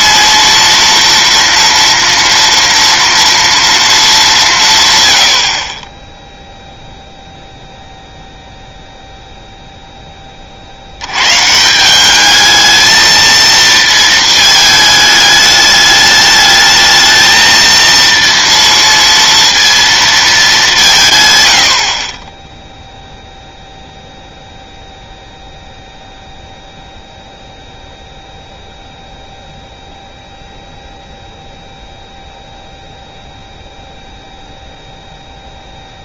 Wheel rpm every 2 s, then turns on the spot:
230, 230, 160, 0, 0, 50, 220, 220, 210, 230, 200, 0, 0, 0, 0, 0, 0, 0.
none